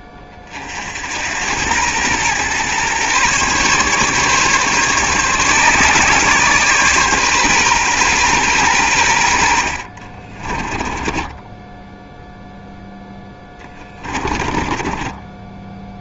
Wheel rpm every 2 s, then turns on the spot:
50, 120, 140, 130, 110, 20, 0, 30.
10-12 14-16